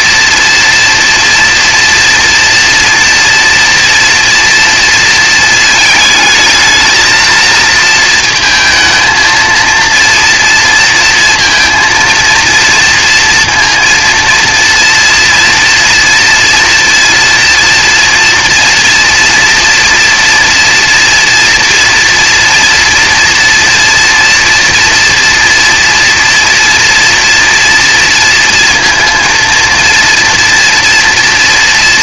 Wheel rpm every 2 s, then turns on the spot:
230, 240, 230, 220, 230, 230, 230, 230, 230, 230, 230, 230, 230, 230, 230, 230.
none